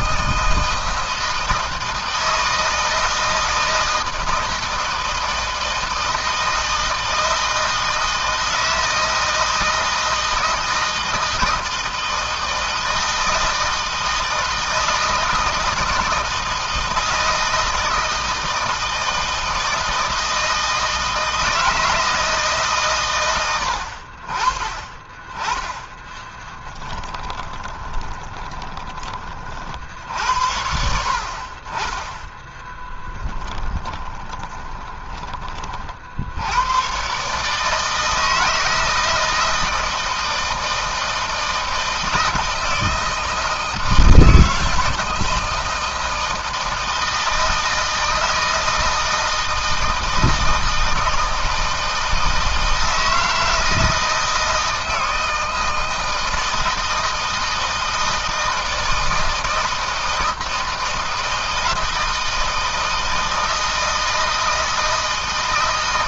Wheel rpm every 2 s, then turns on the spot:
160, 160, 160, 160, 160, 160, 160, 160, 160, 160, 160, 120, 20, 10, 30, 70, 20, 20, 120, 160, 160, 160, 160, 160, 160, 160, 160, 160, 160, 160, 160, 160, 160.
26-28 32-36